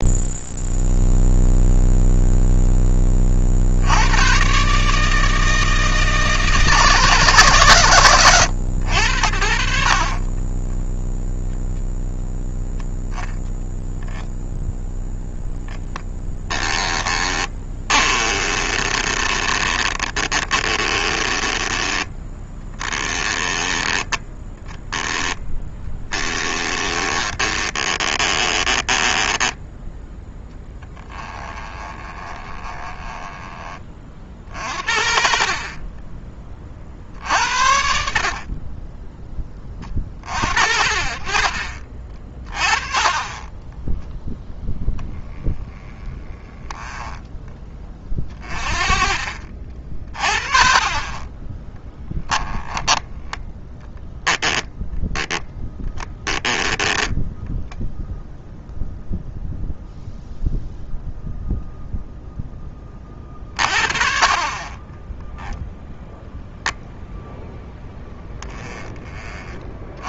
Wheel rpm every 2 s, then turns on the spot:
0, 10, 150, 160, 100, 20, 0, 0, 10, 20, 20, 10, 10, 20, 20, 10, 20, 50, 40, 20, 50, 30, 0, 10, 30, 40, 10, 0, 10, 0, 0, 10, 20, 10, 20.
16-24 26-34 38-40 46-50 66-68